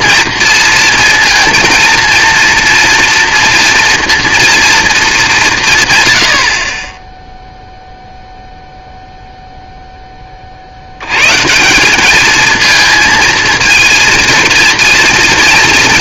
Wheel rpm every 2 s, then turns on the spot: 230, 230, 230, 40, 0, 50, 220, 230.
none